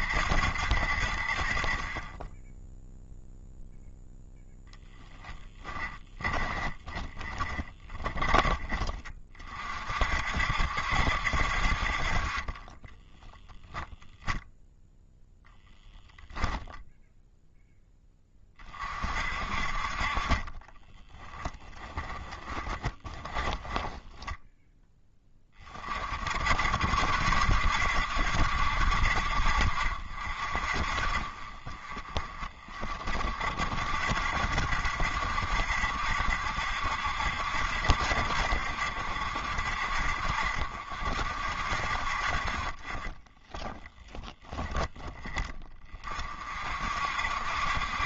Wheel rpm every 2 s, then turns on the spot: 0, 0, 20, 20, 50, 40, 0, 0, 0, 40, 20, 20, 10, 70, 70, 50, 30, 60, 70, 60, 50, 40, 10, 50.
4-8 20-24 42-44